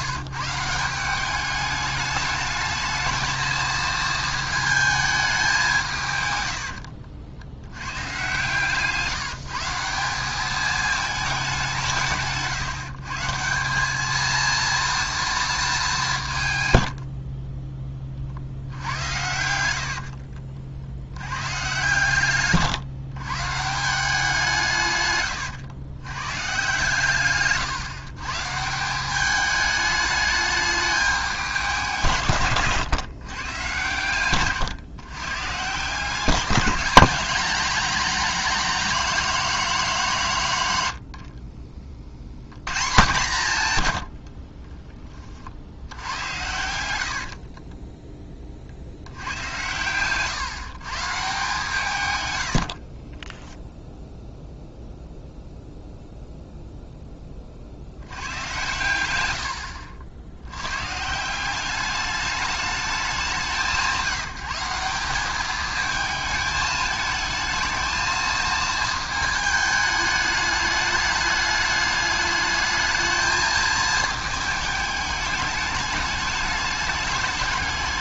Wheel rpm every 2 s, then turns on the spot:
160, 220, 220, 90, 140, 210, 150, 230, 110, 60, 60, 130, 170, 120, 160, 210, 130, 130, 180, 220, 140, 110, 30, 90, 40, 140, 70, 0, 0, 110, 110, 200, 180, 220, 220, 210, 210, 210, 210.
6-8 32-34 44-48 52-54